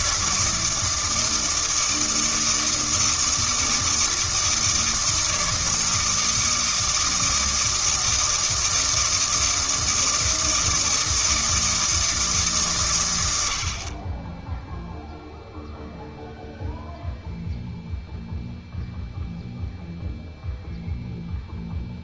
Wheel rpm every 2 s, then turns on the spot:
160, 160, 160, 160, 160, 160, 140, 0, 0, 0, 0.
none